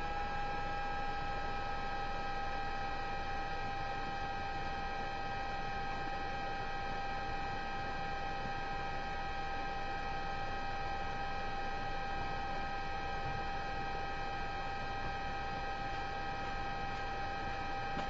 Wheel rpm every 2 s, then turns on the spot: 0, 0, 0, 0, 0, 0, 0, 0, 0.
none